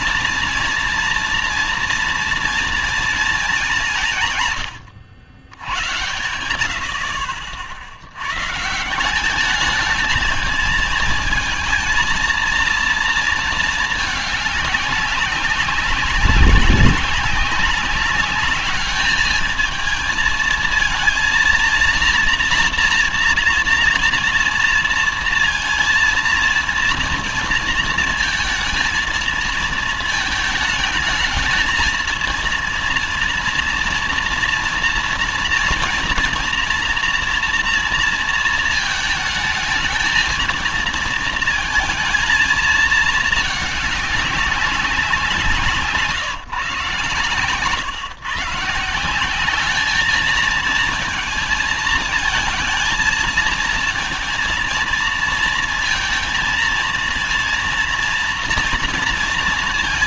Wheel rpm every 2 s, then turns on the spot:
230, 230, 90, 60, 170, 220, 230, 200, 190, 210, 230, 240, 230, 230, 220, 210, 230, 230, 230, 220, 230, 220, 190, 130, 150, 220, 230, 230, 220, 230.
none